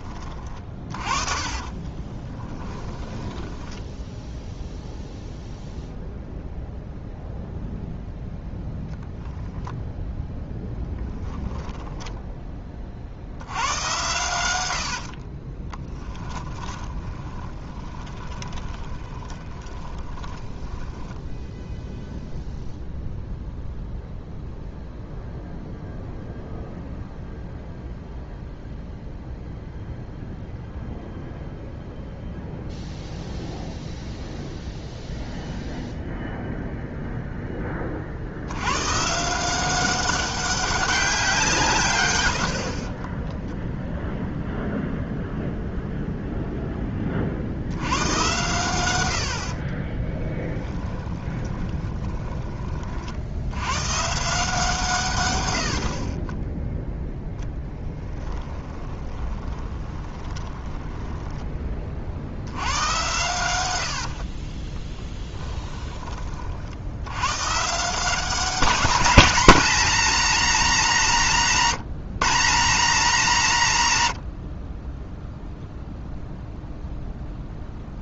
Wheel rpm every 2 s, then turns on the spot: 30, 10, 0, 0, 0, 10, 40, 80, 20, 20, 10, 0, 0, 0, 0, 0, 0, 0, 0, 110, 200, 40, 0, 10, 90, 30, 40, 150, 0, 20, 10, 110, 20, 70, 210, 210, 200, 20, 0.
0-4 10-12 14-22 50-52 58-62 64-66